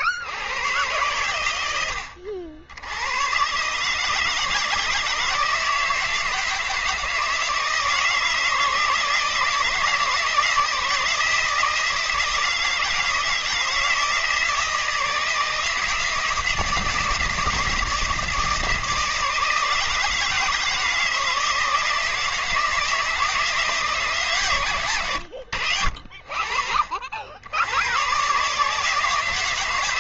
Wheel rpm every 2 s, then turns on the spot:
120, 80, 160, 160, 160, 160, 160, 160, 170, 160, 160, 160, 130, 50, 150.
none